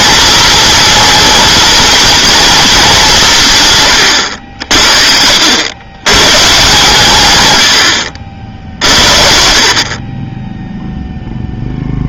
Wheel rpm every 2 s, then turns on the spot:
230, 210, 70, 140, 60, 0.
4-6